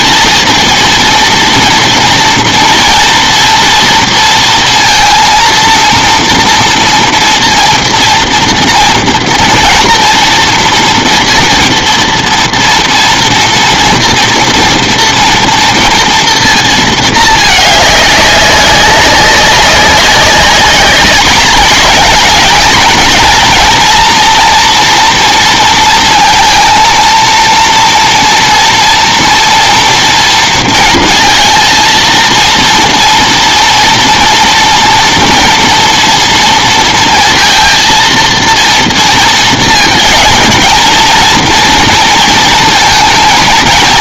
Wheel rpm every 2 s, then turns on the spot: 230, 230, 230, 240, 230, 230, 230, 230, 230, 200, 200, 230, 240, 230, 230, 230, 230, 230, 230, 230, 220, 230.
none